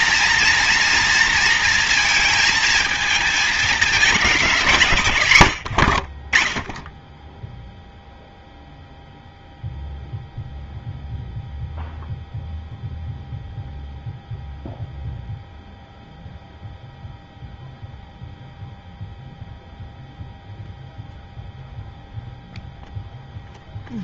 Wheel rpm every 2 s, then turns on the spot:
240, 230, 190, 40, 0, 0, 0, 0, 0, 0, 0, 0.
none